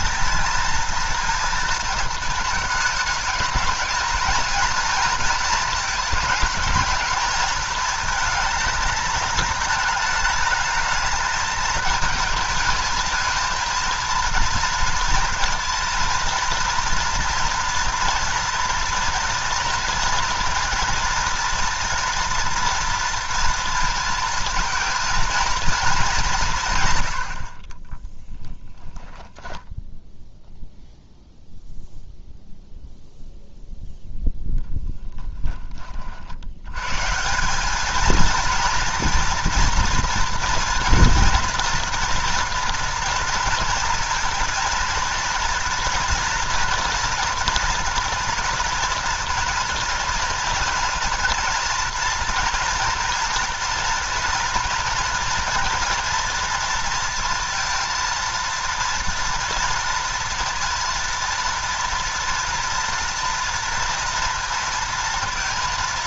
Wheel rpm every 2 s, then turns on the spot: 230, 220, 230, 210, 220, 210, 220, 230, 230, 230, 230, 230, 230, 140, 0, 0, 0, 10, 100, 230, 230, 230, 230, 240, 230, 240, 240, 230, 230, 230, 230, 240, 230.
34-36